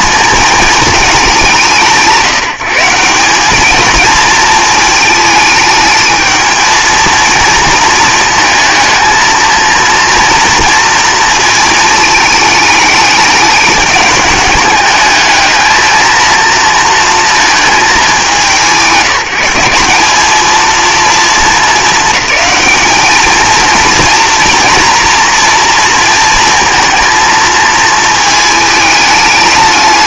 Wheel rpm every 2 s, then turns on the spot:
220, 170, 220, 220, 220, 230, 210, 210, 230, 190, 230, 220, 230, 230, 210.
none